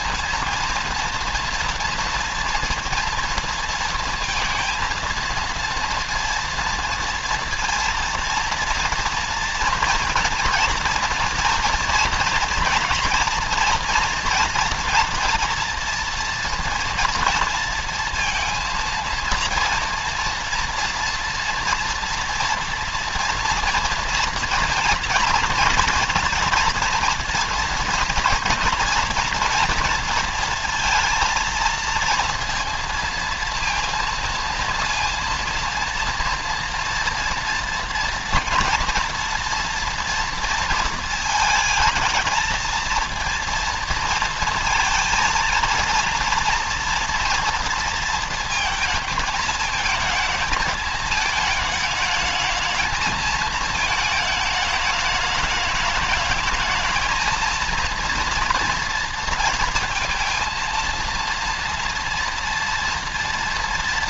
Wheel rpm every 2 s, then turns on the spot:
230, 230, 230, 230, 230, 230, 240, 240, 230, 230, 230, 230, 230, 230, 240, 230, 230, 230, 230, 230, 230, 230, 230, 230, 220, 220, 220, 210, 220, 230, 230, 230.
none